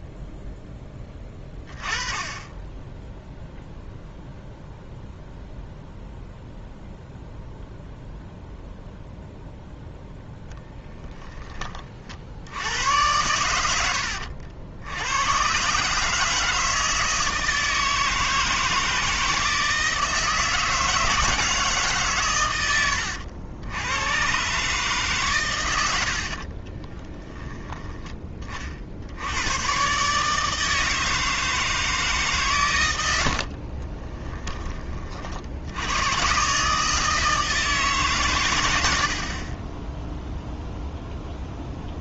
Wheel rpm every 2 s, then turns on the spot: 10, 10, 0, 0, 0, 10, 80, 80, 160, 160, 160, 100, 140, 50, 30, 160, 110, 30, 150, 90, 0.
26-28